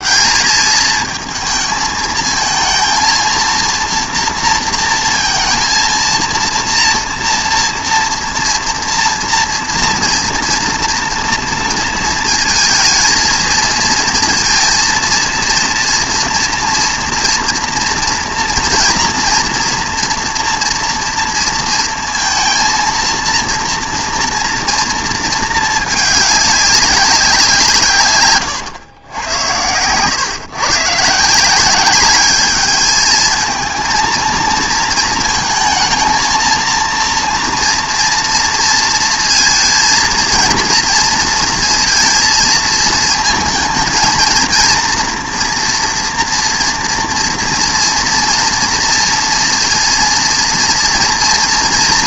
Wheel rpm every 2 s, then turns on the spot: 220, 230, 230, 230, 230, 230, 220, 230, 240, 230, 230, 230, 230, 200, 100, 150, 220, 220, 230, 230, 220, 220, 230, 230, 230, 230.
none